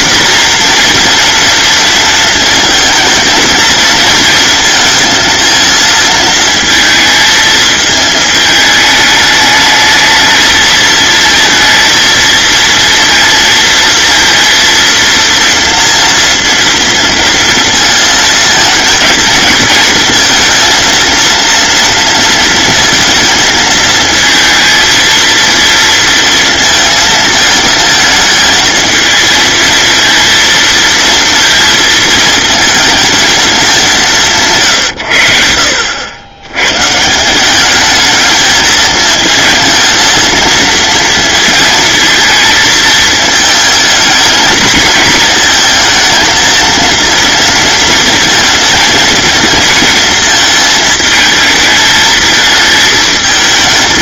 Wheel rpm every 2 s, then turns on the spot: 240, 230, 220, 220, 210, 220, 230, 230, 230, 230, 230, 230, 230, 230, 220, 230, 220, 140, 120, 220, 230, 220, 220, 230, 230, 220, 220.
none